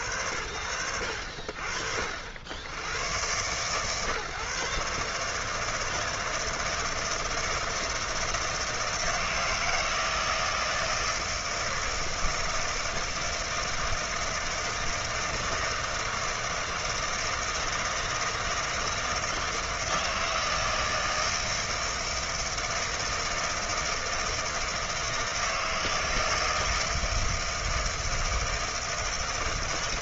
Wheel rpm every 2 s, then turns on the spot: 70, 140, 160, 160, 160, 160, 160, 160, 160, 160, 160, 160, 160, 160, 150.
none